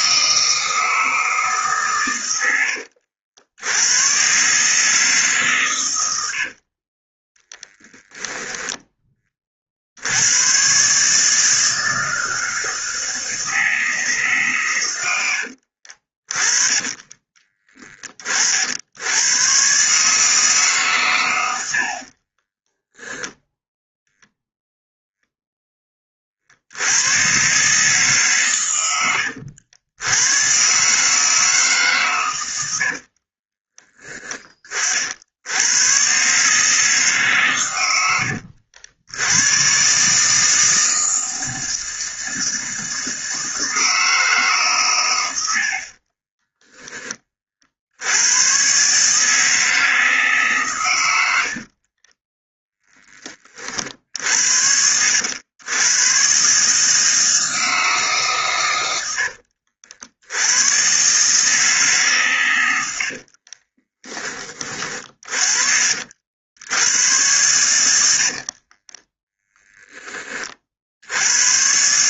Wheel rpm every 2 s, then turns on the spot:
160, 80, 150, 30, 10, 140, 160, 110, 30, 90, 130, 0, 0, 80, 110, 140, 60, 50, 150, 90, 160, 160, 120, 10, 140, 110, 10, 70, 150, 90, 130, 80, 30, 100, 20, 60.
2-4 6-8 16-18 32-34 62-64 68-70